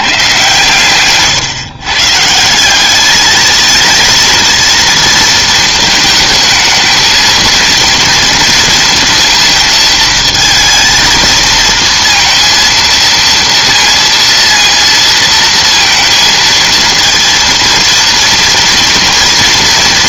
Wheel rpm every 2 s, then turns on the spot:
130, 190, 230, 220, 220, 220, 230, 230, 230, 230.
none